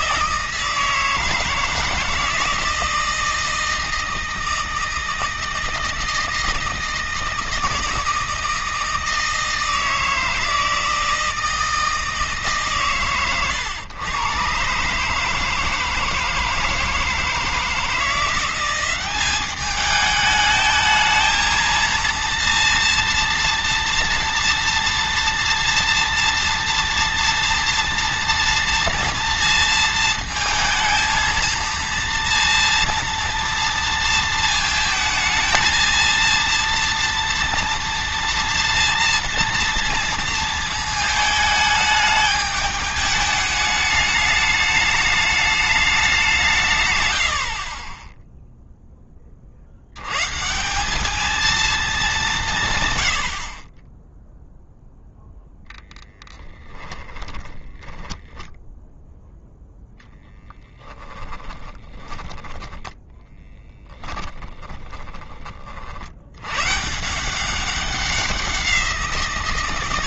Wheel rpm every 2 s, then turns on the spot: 160, 160, 160, 160, 160, 160, 140, 140, 160, 190, 220, 230, 230, 230, 230, 230, 230, 220, 230, 230, 220, 210, 210, 110, 10, 190, 130, 0, 10, 10, 10, 10, 10, 140, 180.
56-64